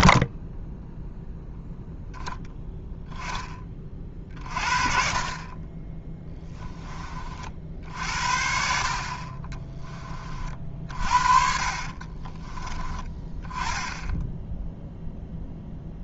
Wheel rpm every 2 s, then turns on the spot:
30, 10, 40, 30, 50, 50, 20, 0.
10-12